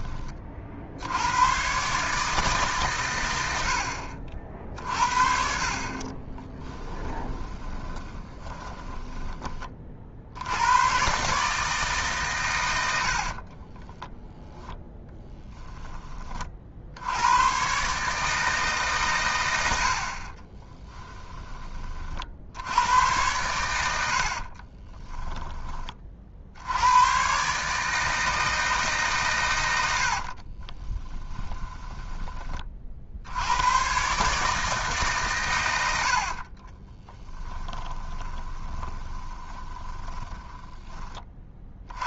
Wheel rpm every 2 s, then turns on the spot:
60, 130, 50, 20, 10, 110, 80, 0, 60, 140, 20, 80, 30, 80, 150, 30, 40, 150, 40, 20, 20.
6-10 20-22 24-26 30-32 36-42